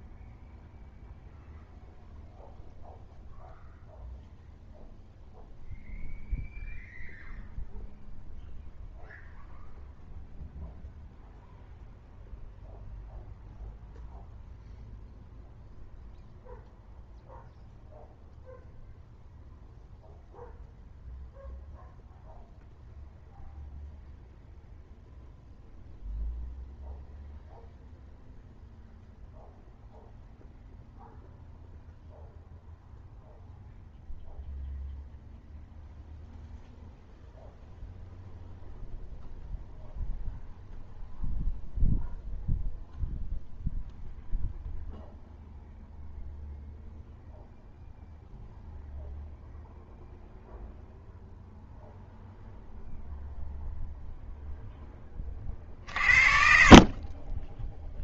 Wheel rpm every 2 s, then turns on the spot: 0, 0, 0, 0, 0, 0, 0, 0, 0, 0, 0, 0, 0, 0, 0, 0, 0, 0, 0, 0, 0, 0, 0, 0, 0, 0, 0, 10, 40.
none